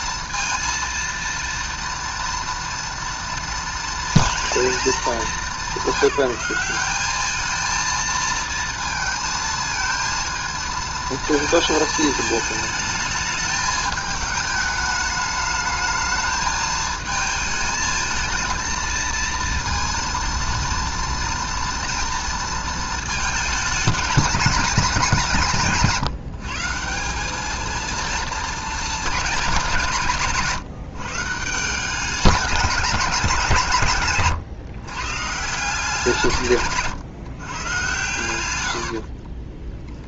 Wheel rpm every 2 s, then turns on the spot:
230, 230, 230, 190, 230, 230, 220, 210, 220, 230, 230, 230, 200, 170, 220, 160, 200, 130, 140, 90.
36-40